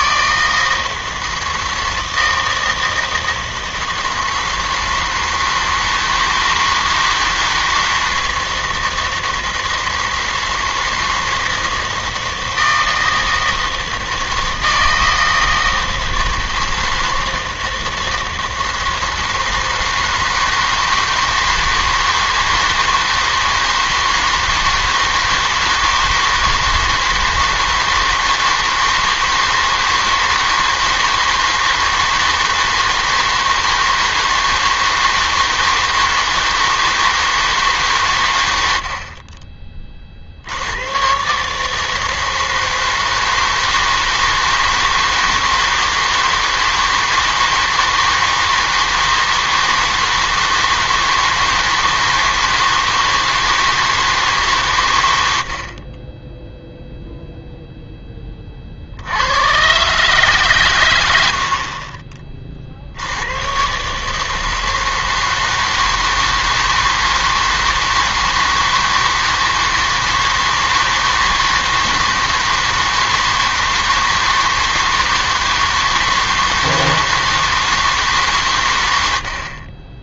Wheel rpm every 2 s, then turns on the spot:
160, 160, 160, 160, 160, 160, 160, 160, 160, 160, 160, 160, 160, 160, 160, 160, 160, 160, 160, 80, 90, 160, 160, 160, 160, 160, 160, 140, 0, 40, 130, 50, 160, 160, 160, 160, 160, 160, 160, 110.
none